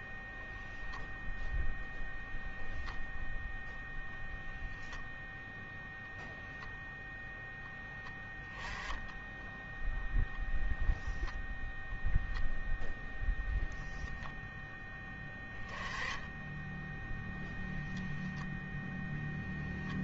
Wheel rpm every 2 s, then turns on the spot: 0, 0, 0, 0, 10, 0, 0, 10, 10, 0.
none